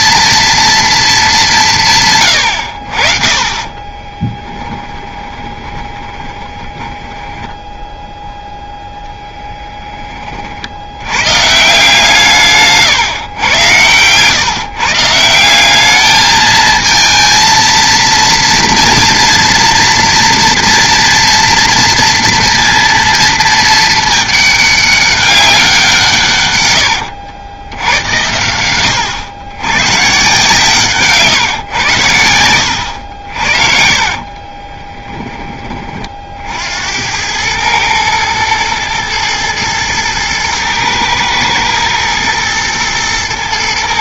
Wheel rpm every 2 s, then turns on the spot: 230, 80, 20, 10, 0, 60, 140, 140, 220, 230, 230, 230, 210, 110, 90, 150, 90, 20, 70, 110, 120, 120.
2-8 26-28 34-36